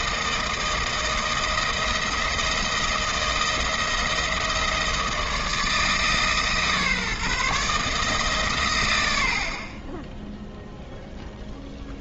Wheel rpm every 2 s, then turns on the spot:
160, 170, 160, 150, 110, 0.
none